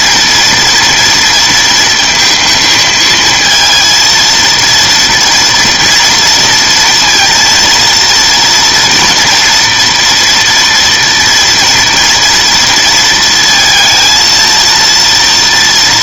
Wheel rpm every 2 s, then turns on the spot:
230, 220, 230, 230, 240, 230, 230, 230.
none